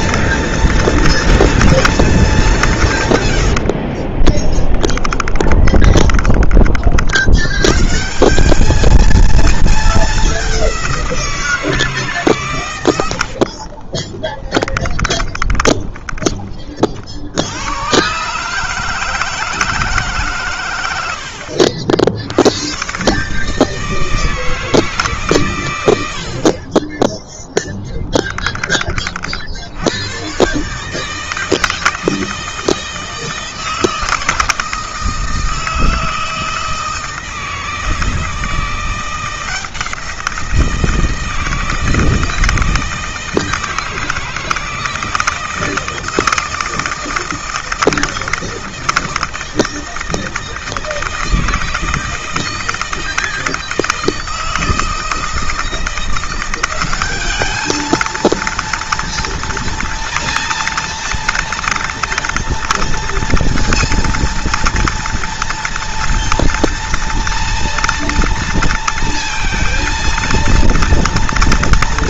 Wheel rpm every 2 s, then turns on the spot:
230, 140, 10, 60, 220, 180, 90, 20, 50, 160, 90, 120, 150, 20, 40, 140, 160, 160, 160, 170, 170, 160, 160, 160, 160, 160, 160, 160, 200, 230, 230, 230, 230, 230, 230, 230.
4-6 12-16